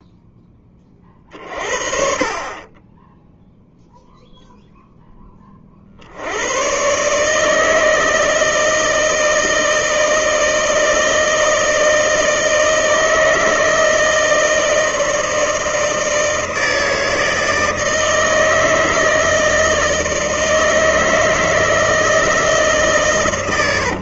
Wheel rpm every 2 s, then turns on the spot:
30, 10, 0, 130, 160, 160, 160, 160, 160, 160, 160, 140.
none